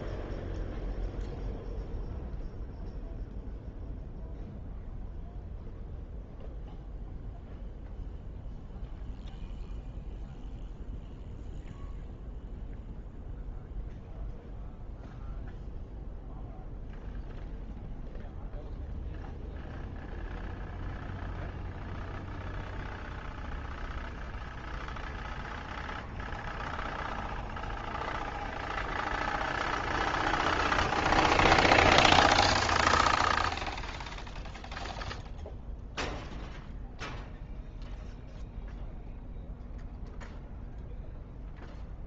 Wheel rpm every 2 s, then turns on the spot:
0, 0, 0, 0, 0, 0, 0, 0, 0, 0, 0, 0, 0, 0, 0, 0, 0, 0, 0, 0, 0.
none